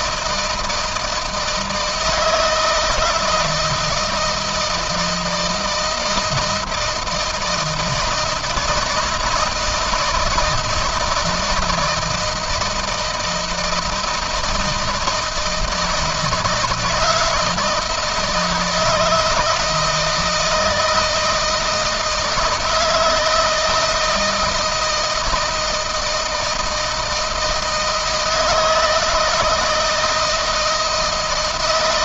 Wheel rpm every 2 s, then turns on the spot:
160, 160, 160, 160, 160, 160, 160, 160, 160, 160, 160, 170, 160, 160, 160, 160.
none